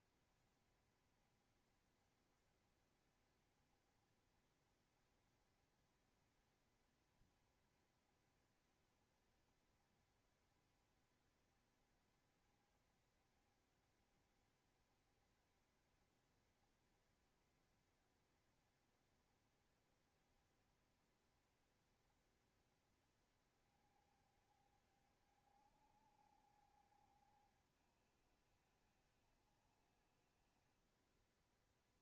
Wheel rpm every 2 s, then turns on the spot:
70, 70, 70, 60, 70, 70, 70, 70, 60, 70, 70, 70, 70, 60, 70, 70.
none